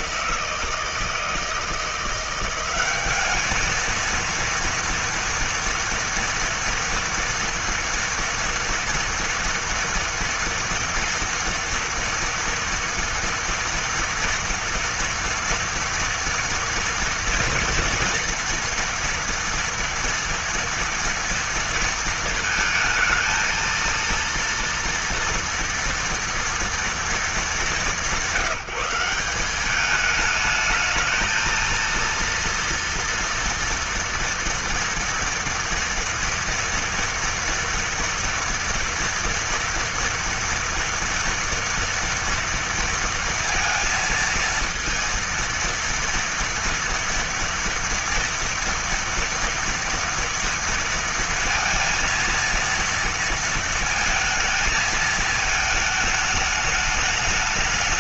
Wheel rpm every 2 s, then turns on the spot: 160, 190, 230, 230, 240, 240, 230, 230, 230, 230, 230, 220, 230, 240, 180, 210, 230, 230, 230, 230, 230, 230, 230, 230, 230, 230, 230, 220, 210.
none